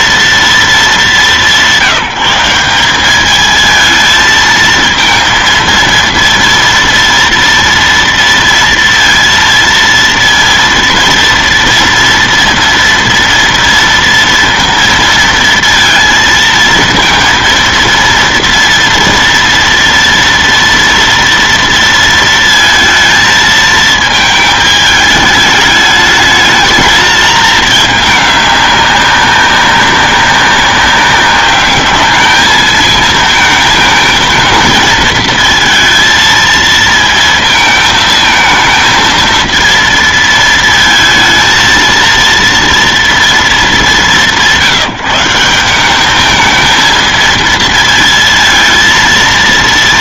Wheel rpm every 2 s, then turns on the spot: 200, 190, 230, 230, 230, 230, 230, 230, 230, 230, 230, 230, 210, 220, 200, 200, 220, 230, 230, 230, 220, 230, 180, 220, 230.
none